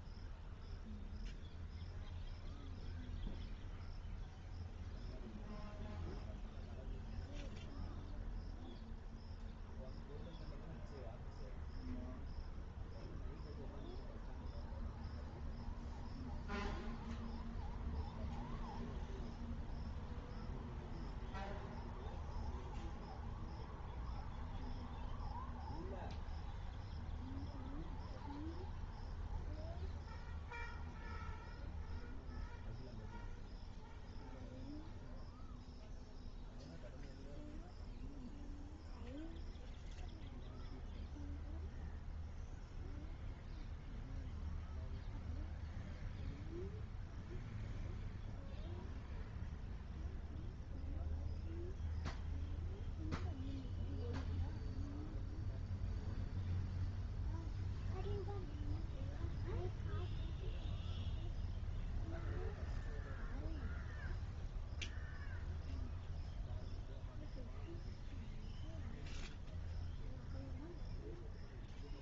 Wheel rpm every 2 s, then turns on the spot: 0, 0, 0, 0, 0, 0, 0, 0, 0, 0, 0, 0, 0, 0, 0, 0, 0, 0, 0, 0, 0, 0, 0, 0, 0, 0, 0, 0, 0, 0, 0, 0, 0, 0, 0, 0.
none